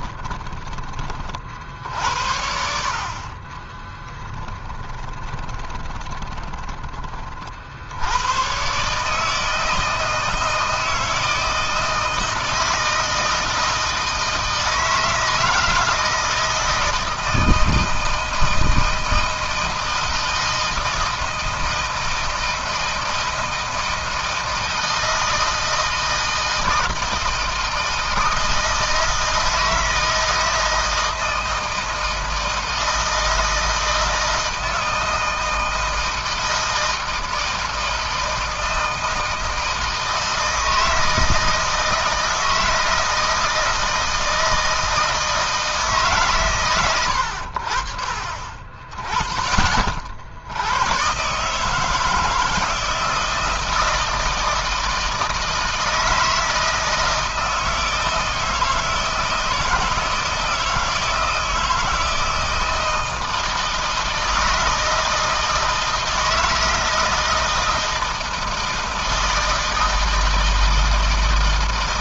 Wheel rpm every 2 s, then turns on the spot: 20, 50, 20, 30, 130, 160, 160, 160, 160, 160, 160, 160, 160, 160, 160, 160, 160, 160, 160, 160, 160, 160, 160, 100, 30, 100, 160, 160, 160, 160, 160, 160, 160, 160, 160, 160.
4-6